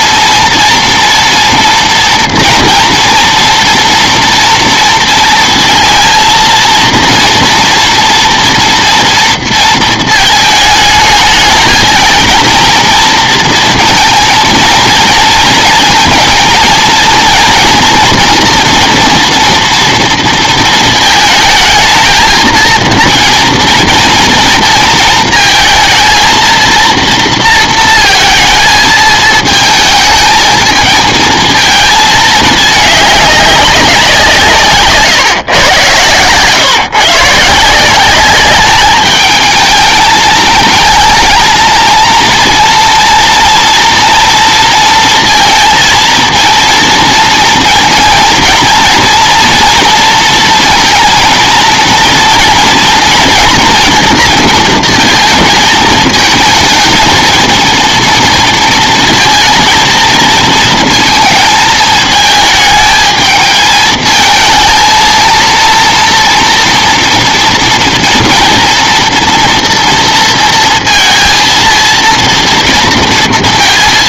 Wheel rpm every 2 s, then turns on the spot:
230, 230, 230, 230, 230, 220, 230, 220, 230, 230, 230, 230, 230, 230, 220, 220, 210, 160, 130, 200, 220, 230, 230, 230, 230, 230, 230, 230, 220, 230, 230, 220, 230, 230, 230, 230, 230.
none